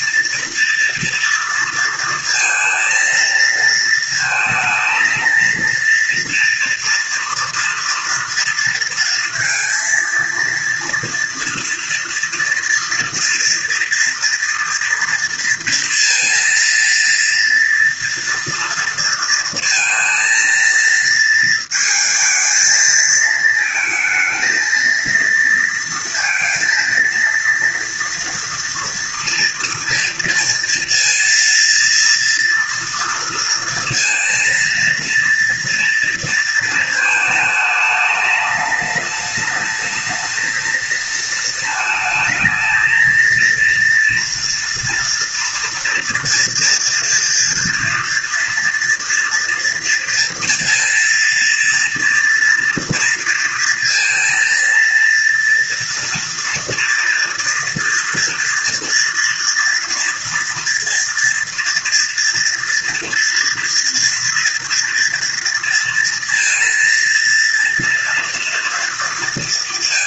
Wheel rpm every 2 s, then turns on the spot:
230, 230, 230, 240, 230, 230, 230, 230, 230, 230, 230, 230, 230, 230, 230, 230, 230, 230, 220, 210, 220, 230, 230, 230, 230, 230, 230, 230, 230, 240, 230, 230, 230, 230, 230.
none